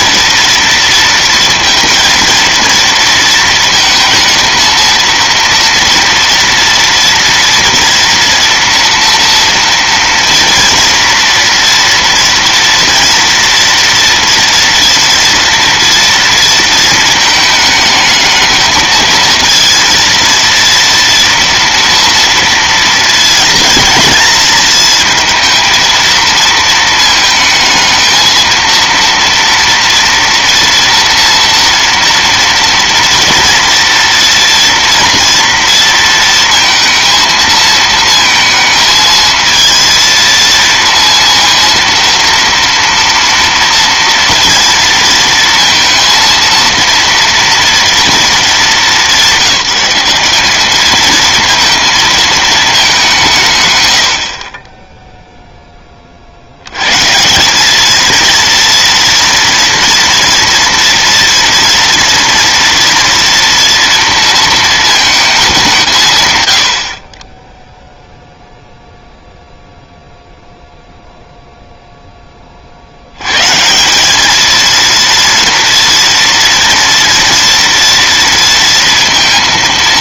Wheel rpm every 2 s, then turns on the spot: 230, 230, 230, 230, 230, 230, 230, 230, 220, 220, 230, 230, 230, 220, 230, 230, 230, 230, 230, 220, 230, 230, 230, 230, 200, 210, 200, 10, 150, 230, 230, 230, 220, 20, 0, 0, 170, 230, 230, 220.
none